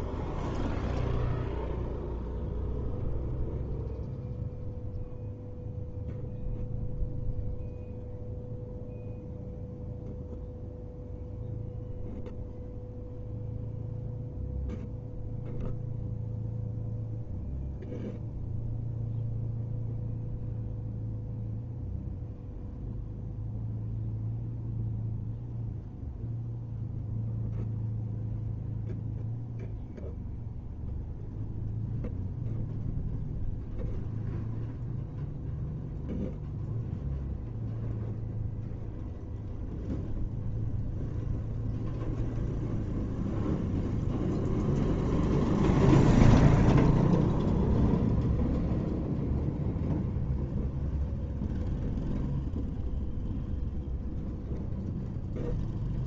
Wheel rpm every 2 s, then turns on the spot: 0, 0, 0, 0, 0, 0, 0, 0, 0, 0, 0, 0, 0, 0, 0, 0, 0, 0, 0, 0, 0, 0, 0, 0, 0, 0, 0, 0.
none